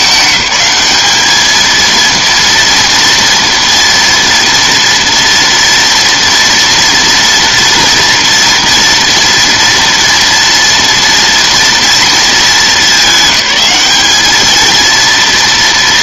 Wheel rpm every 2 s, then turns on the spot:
210, 230, 230, 230, 230, 240, 210, 220.
none